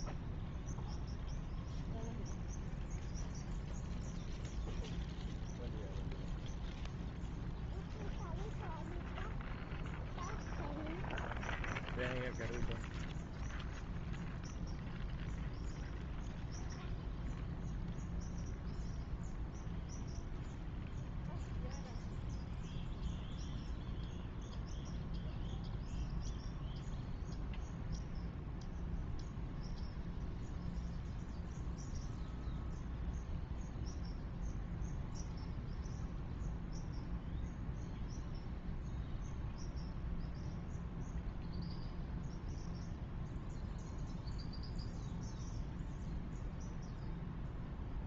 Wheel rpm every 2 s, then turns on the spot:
0, 0, 0, 0, 0, 0, 0, 0, 0, 0, 0, 0, 0, 0, 0, 0, 0, 0, 0, 0, 0, 0, 0, 0.
none